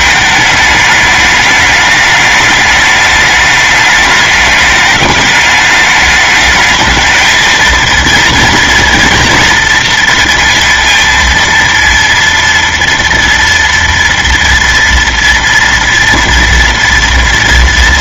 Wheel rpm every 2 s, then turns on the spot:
210, 210, 210, 210, 230, 230, 230, 230, 230.
none